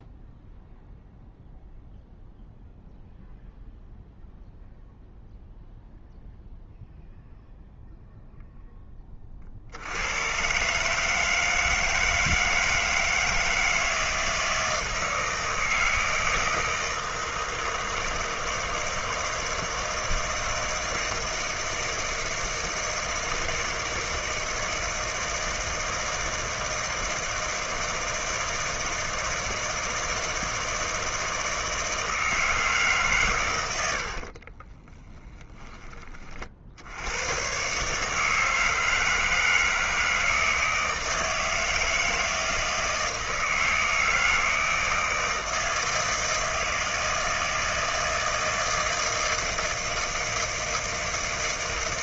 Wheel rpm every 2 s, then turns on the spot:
0, 0, 0, 0, 30, 160, 160, 160, 160, 160, 160, 160, 160, 160, 160, 160, 140, 10, 100, 160, 160, 160, 160, 160, 160, 160.
34-36